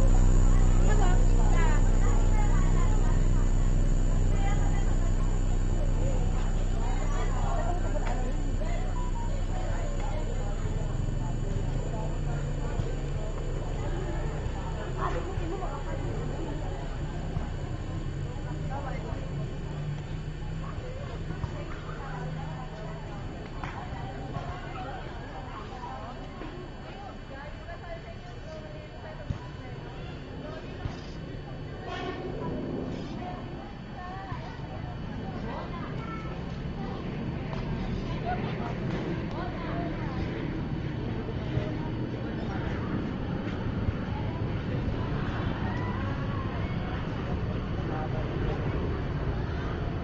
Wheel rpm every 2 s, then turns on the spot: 0, 0, 0, 0, 0, 0, 0, 0, 0, 0, 0, 0, 0, 0, 0, 0, 0, 0, 0, 0, 0, 0, 0, 0, 0.
none